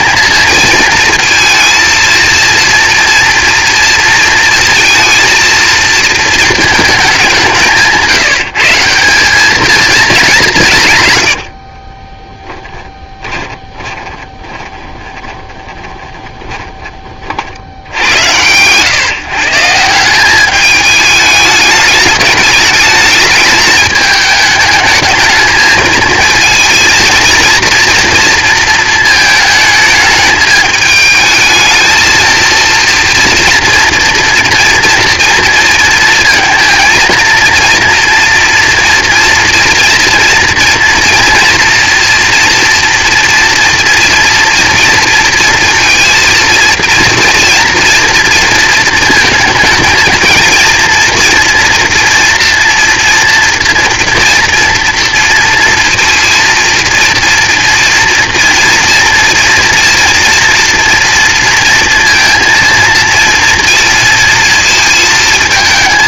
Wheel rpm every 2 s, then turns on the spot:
230, 230, 230, 210, 160, 160, 10, 20, 20, 130, 210, 210, 210, 230, 220, 220, 230, 240, 230, 230, 230, 230, 230, 230, 230, 230, 230, 230, 230, 230, 230, 230, 220.
12-16